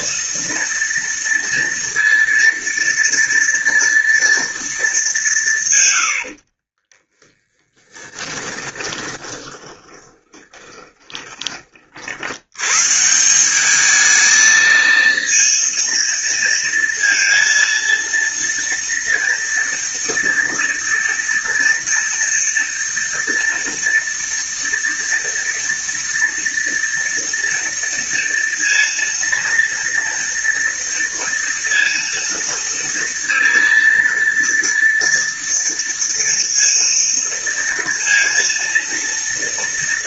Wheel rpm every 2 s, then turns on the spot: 230, 230, 220, 40, 20, 20, 130, 220, 230, 230, 230, 230, 230, 230, 230, 230, 230, 230, 230, 230.
6-12